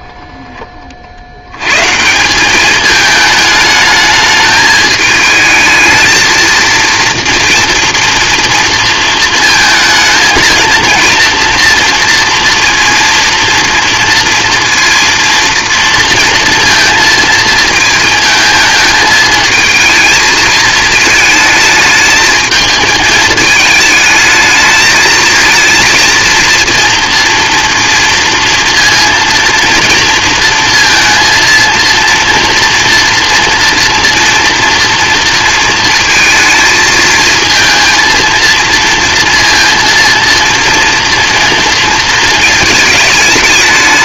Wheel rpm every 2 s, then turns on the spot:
20, 210, 210, 230, 230, 230, 230, 230, 230, 220, 220, 220, 220, 230, 230, 230, 230, 230, 220, 230, 230, 220.
none